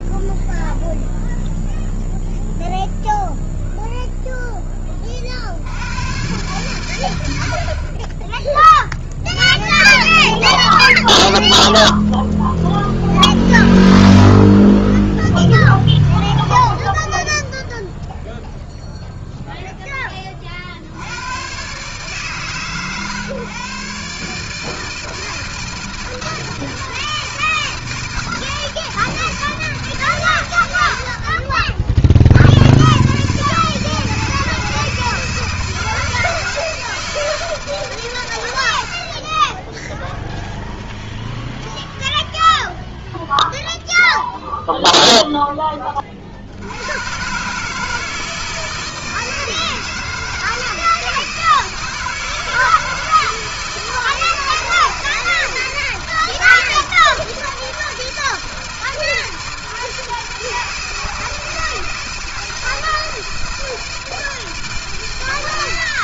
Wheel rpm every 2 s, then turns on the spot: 0, 0, 0, 100, 30, 10, 20, 20, 10, 0, 10, 130, 140, 160, 160, 130, 50, 160, 160, 130, 0, 0, 0, 40, 160, 160, 160, 160, 160, 160, 160, 160, 160.
10-16